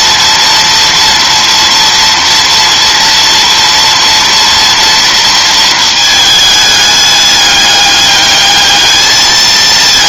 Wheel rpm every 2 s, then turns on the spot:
230, 230, 230, 210, 220.
none